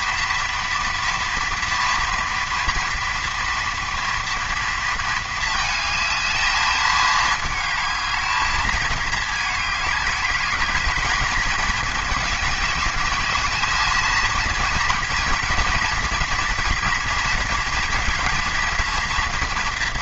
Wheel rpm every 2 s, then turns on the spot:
230, 230, 230, 220, 220, 220, 210, 230, 240, 230.
none